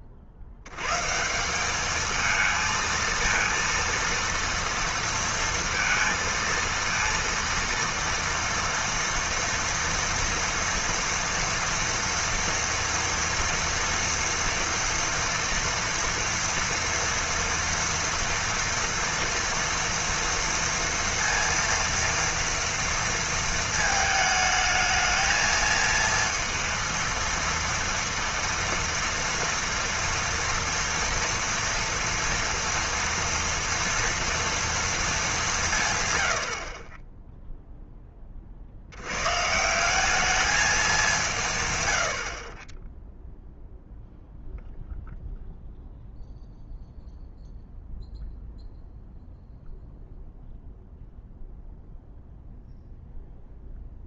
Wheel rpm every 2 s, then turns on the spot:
90, 230, 230, 230, 230, 230, 230, 230, 230, 230, 230, 230, 220, 230, 230, 230, 230, 230, 60, 40, 210, 30, 0, 0, 0, 0, 0.
none